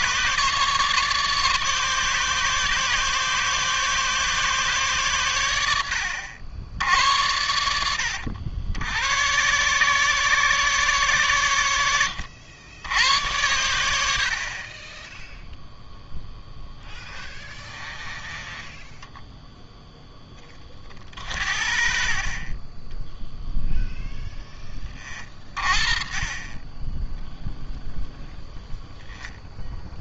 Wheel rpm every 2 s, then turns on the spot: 150, 150, 130, 70, 90, 130, 90, 30, 10, 10, 30, 20, 20, 10, 0.
16-18